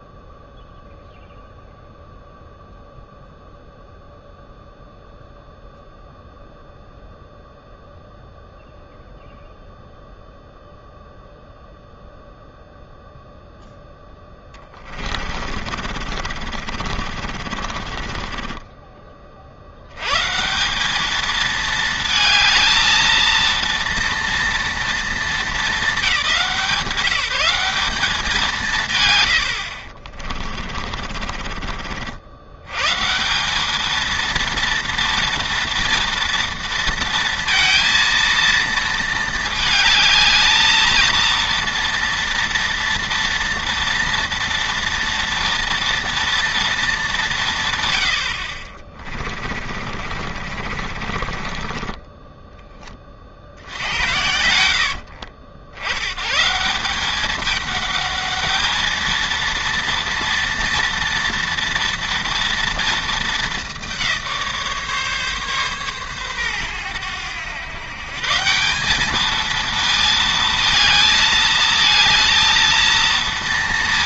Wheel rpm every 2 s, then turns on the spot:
0, 0, 0, 0, 0, 0, 0, 30, 40, 20, 170, 230, 230, 180, 160, 40, 110, 230, 230, 230, 220, 230, 230, 230, 40, 50, 20, 80, 170, 220, 230, 230, 160, 100, 180, 220, 230.
14-20 30-32 48-52 54-56